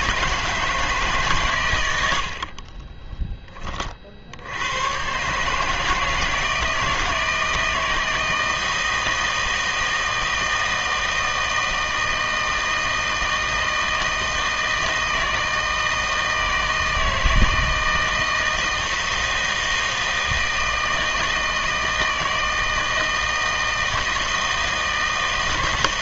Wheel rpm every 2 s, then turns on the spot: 160, 40, 90, 160, 160, 160, 160, 160, 160, 160, 160, 160, 160.
none